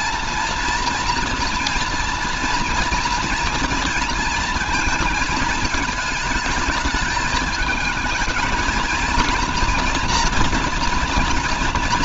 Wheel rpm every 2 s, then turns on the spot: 240, 230, 220, 220, 230, 240.
none